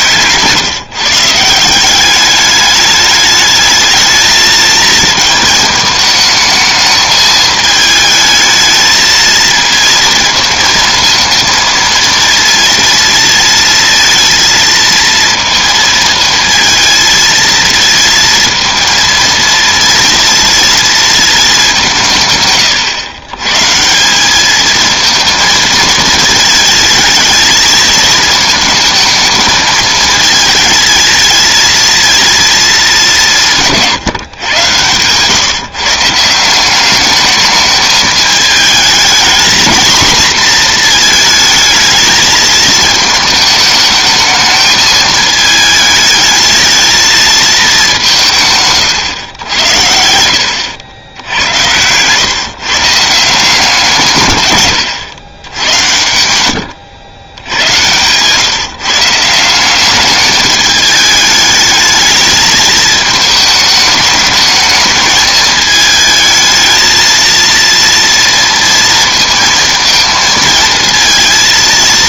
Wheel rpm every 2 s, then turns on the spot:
150, 210, 220, 220, 220, 220, 230, 230, 220, 230, 230, 120, 220, 220, 220, 220, 220, 120, 180, 210, 230, 220, 220, 220, 140, 90, 140, 100, 90, 150, 210, 220, 220, 220, 230, 230.
56-58